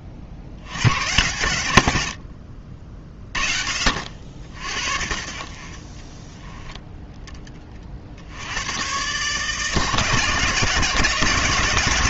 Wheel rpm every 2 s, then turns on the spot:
70, 60, 60, 10, 90, 150.
none